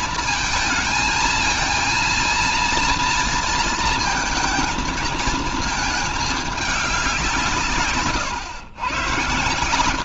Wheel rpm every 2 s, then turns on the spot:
220, 230, 220, 200, 110.
none